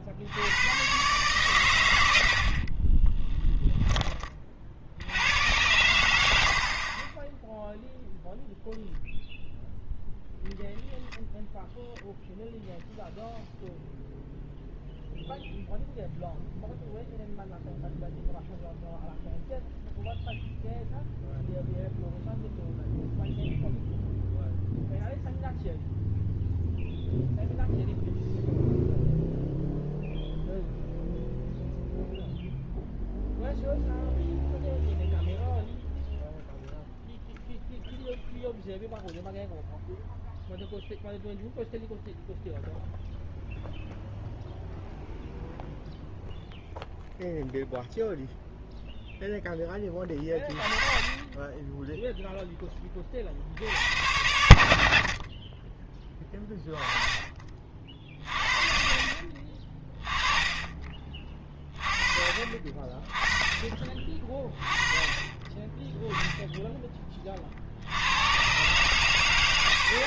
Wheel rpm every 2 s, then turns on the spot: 100, 50, 50, 50, 0, 10, 0, 0, 0, 0, 0, 0, 0, 0, 0, 0, 0, 0, 0, 0, 0, 0, 0, 0, 0, 20, 10, 70, 20, 40, 30, 40, 20, 10, 120.
2-4